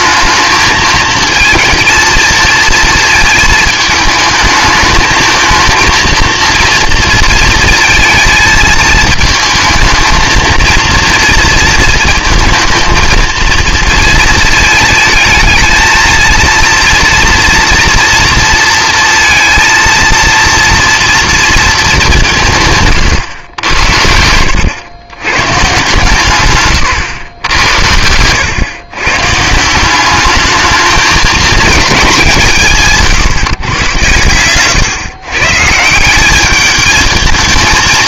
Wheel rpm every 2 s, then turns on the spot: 220, 230, 220, 230, 220, 230, 230, 220, 230, 230, 230, 150, 100, 110, 120, 220, 160, 120, 210.
26-28